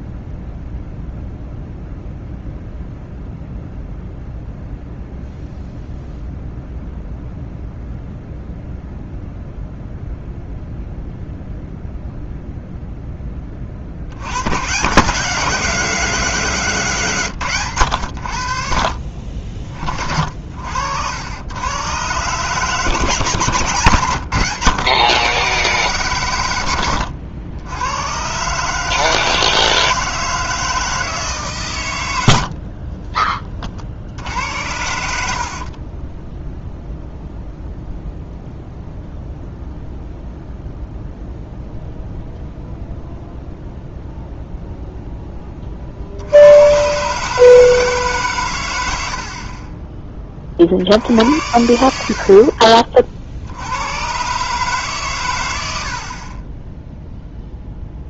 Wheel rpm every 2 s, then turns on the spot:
0, 0, 0, 0, 0, 0, 0, 150, 160, 50, 70, 160, 130, 90, 150, 160, 60, 80, 0, 0, 0, 0, 0, 110, 100, 60, 40, 140, 0.
32-34